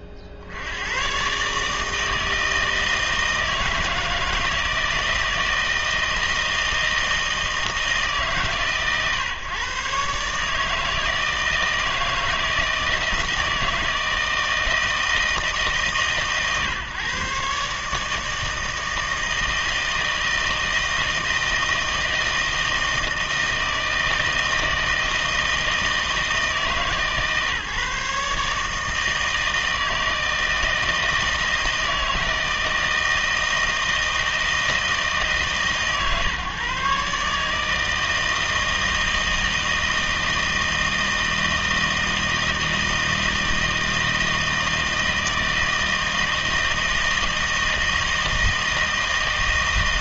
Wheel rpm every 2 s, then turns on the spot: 50, 160, 160, 160, 130, 150, 160, 160, 130, 160, 160, 160, 160, 150, 150, 160, 160, 160, 130, 160, 160, 160, 160, 160, 160.
none